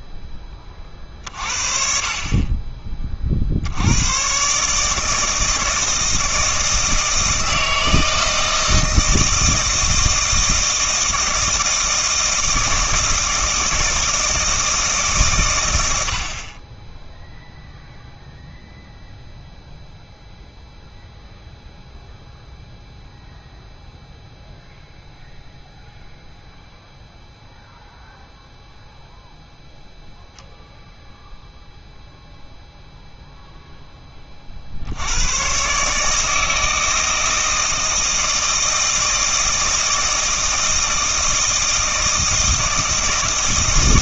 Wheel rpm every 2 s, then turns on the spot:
30, 30, 150, 160, 160, 160, 160, 160, 20, 0, 0, 0, 0, 0, 0, 0, 0, 60, 160, 160, 160, 160.
none